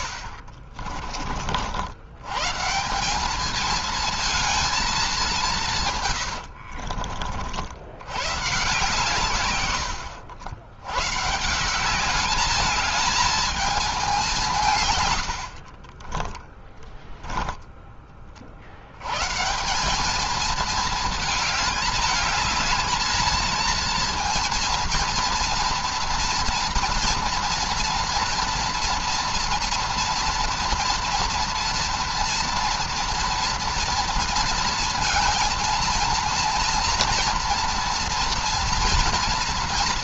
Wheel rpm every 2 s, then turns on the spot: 60, 130, 220, 90, 130, 90, 210, 180, 10, 60, 210, 220, 230, 230, 230, 230, 240, 230, 230, 240.
0-2 6-8 16-18